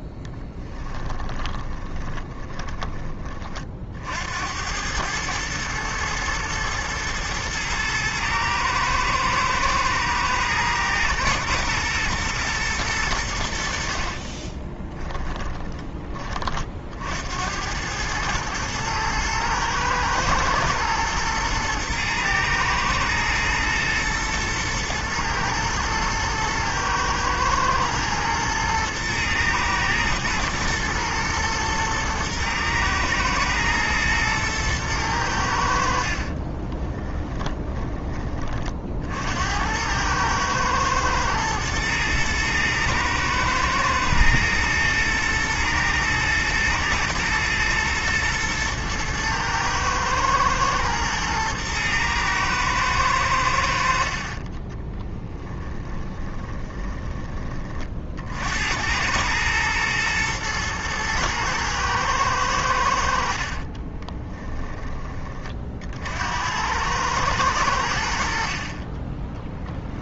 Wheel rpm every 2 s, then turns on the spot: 10, 20, 100, 110, 110, 120, 100, 10, 50, 110, 110, 110, 120, 110, 110, 110, 120, 110, 30, 50, 110, 110, 110, 110, 110, 120, 110, 10, 20, 100, 120, 70, 20, 100, 30.
0-2 14-16 36-38 54-56